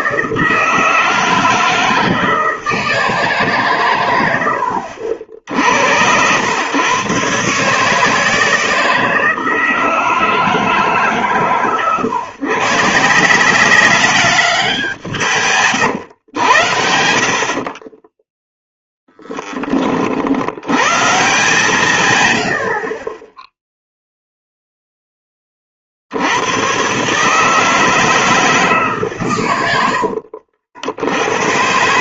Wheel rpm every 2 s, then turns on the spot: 160, 160, 100, 100, 160, 160, 130, 200, 110, 10, 80, 100, 0, 100, 160, 60.
18-20 30-32